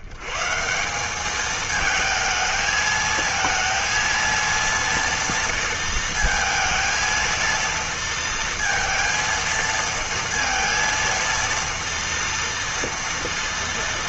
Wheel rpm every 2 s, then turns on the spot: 120, 220, 230, 230, 230, 230, 230.
none